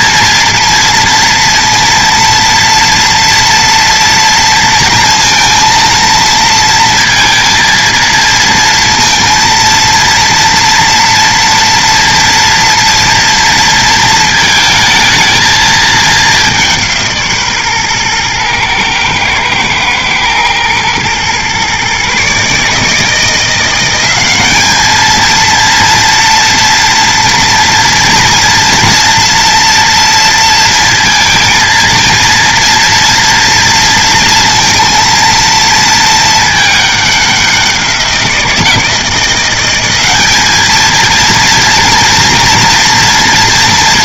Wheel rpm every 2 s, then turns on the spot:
230, 230, 230, 230, 230, 230, 230, 220, 180, 110, 110, 150, 200, 230, 230, 230, 240, 230, 210, 170, 220, 240.
none